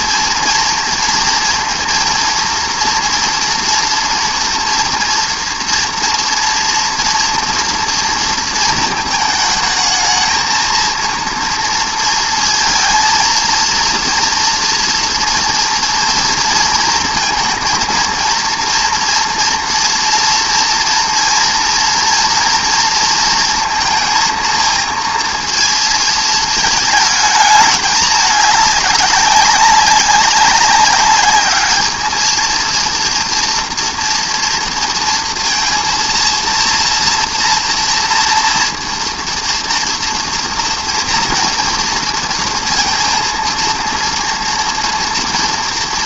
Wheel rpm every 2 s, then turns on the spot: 230, 230, 230, 230, 220, 230, 230, 230, 230, 230, 230, 230, 230, 220, 200, 200, 230, 230, 230, 230, 230, 230, 230.
none